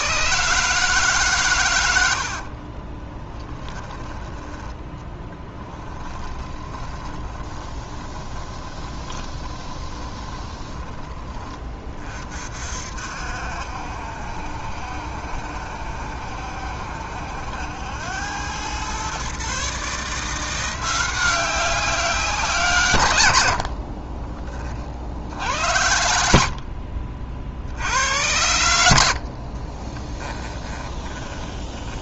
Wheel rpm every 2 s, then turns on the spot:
150, 40, 20, 20, 20, 10, 50, 70, 70, 110, 180, 150, 40, 50, 70, 10.
2-4 6-12 30-32